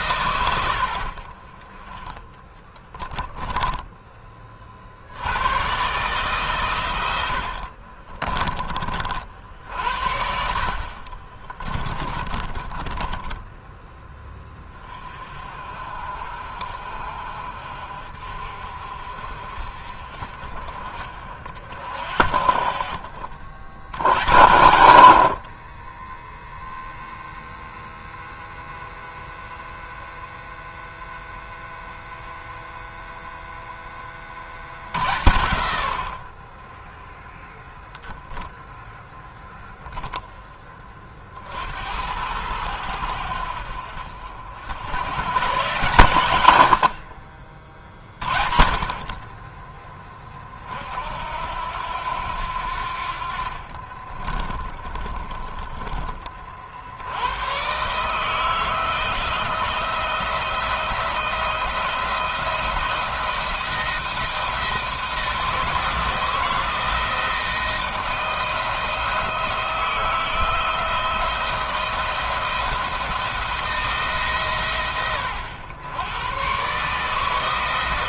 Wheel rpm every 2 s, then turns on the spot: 100, 10, 50, 120, 30, 50, 20, 30, 50, 50, 40, 50, 100, 0, 0, 0, 0, 60, 20, 0, 20, 90, 90, 80, 60, 50, 70, 40, 70, 160, 160, 170, 160, 160, 160, 160, 170, 130, 140.
0-4 10-14 54-56